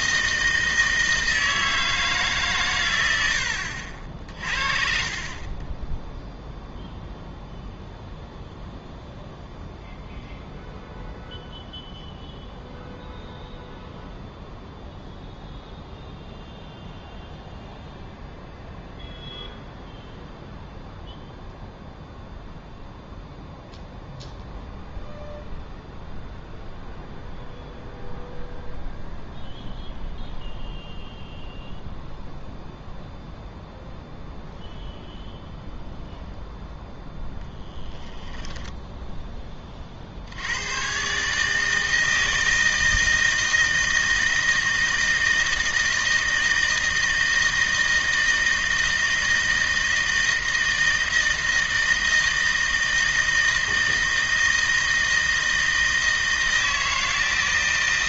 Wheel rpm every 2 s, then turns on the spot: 160, 130, 40, 0, 0, 0, 0, 0, 0, 0, 0, 0, 0, 0, 0, 0, 0, 0, 0, 10, 100, 160, 160, 160, 160, 160, 160, 160, 160.
none